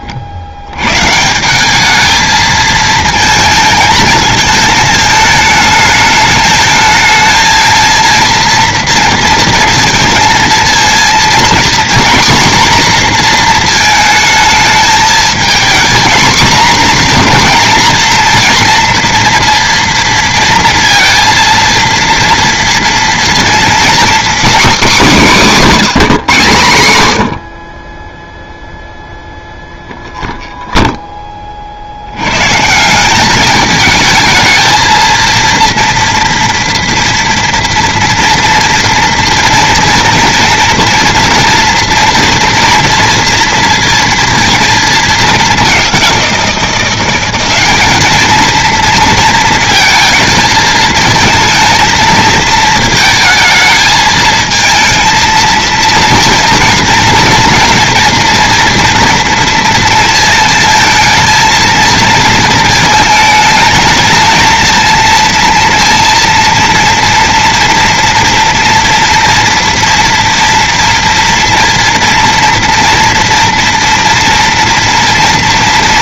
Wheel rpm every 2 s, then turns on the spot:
80, 220, 220, 220, 230, 230, 240, 220, 240, 230, 230, 230, 250, 130, 0, 0, 140, 220, 230, 230, 230, 230, 230, 180, 230, 220, 220, 230, 230, 230, 230, 220, 230, 230, 240, 230, 230, 230.
none